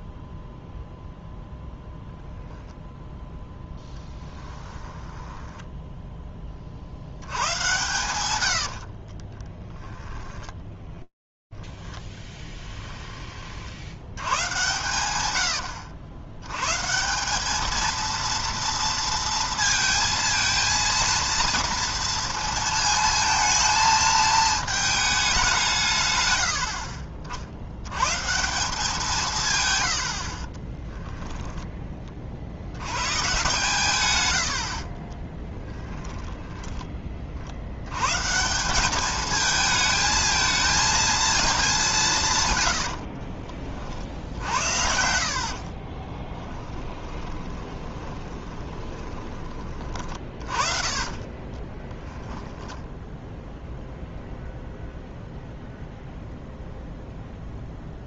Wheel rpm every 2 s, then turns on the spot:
0, 0, 10, 50, 60, 10, 30, 90, 190, 230, 230, 220, 200, 40, 180, 10, 100, 40, 10, 170, 220, 110, 70, 20, 20, 40, 10, 0, 0.
4-6 8-12 30-32 42-44 46-52